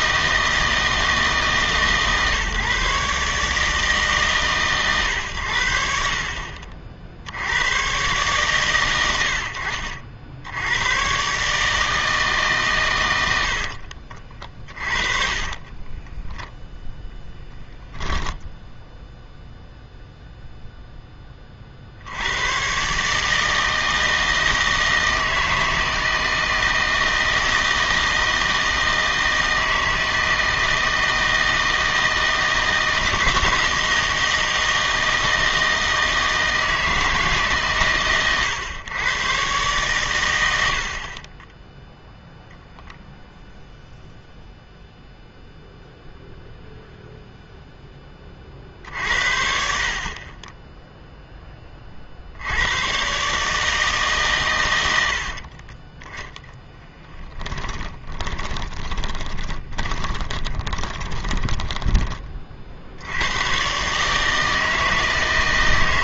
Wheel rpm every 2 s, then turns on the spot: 160, 140, 120, 50, 90, 100, 130, 40, 0, 0, 0, 120, 160, 160, 160, 160, 160, 160, 160, 120, 70, 0, 0, 0, 50, 10, 100, 100, 10, 20, 20, 60, 160.
14-16 56-62